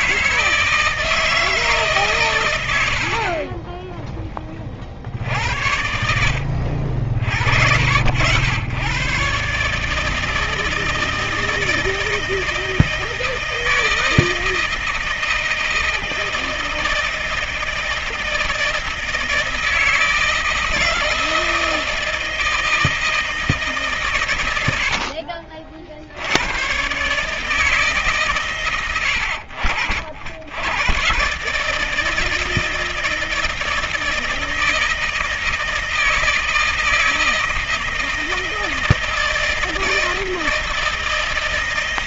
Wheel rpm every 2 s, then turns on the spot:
160, 110, 10, 70, 100, 160, 160, 160, 160, 160, 160, 160, 100, 90, 120, 90, 160, 160, 160, 160, 160.
none